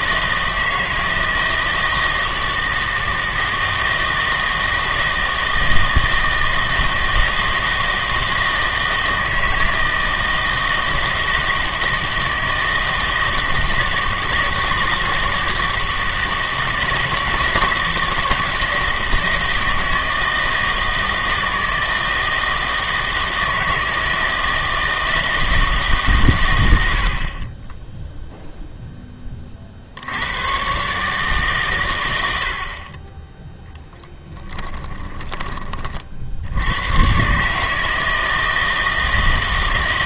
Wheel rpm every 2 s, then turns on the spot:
160, 160, 160, 160, 160, 160, 160, 160, 160, 160, 160, 160, 160, 110, 0, 120, 60, 20, 90, 160.
34-36